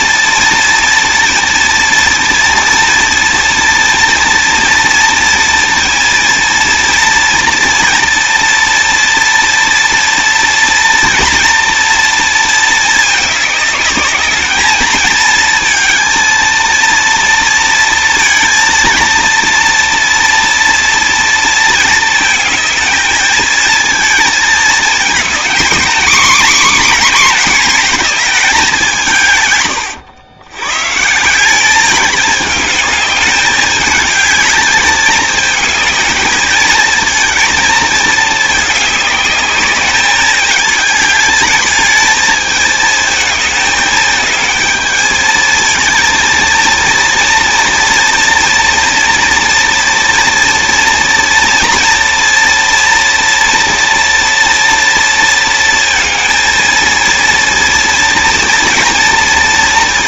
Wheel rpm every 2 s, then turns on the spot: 230, 230, 230, 240, 240, 230, 220, 220, 230, 230, 240, 220, 220, 260, 200, 130, 210, 220, 220, 210, 210, 220, 220, 230, 230, 230, 230, 230, 230, 230.
none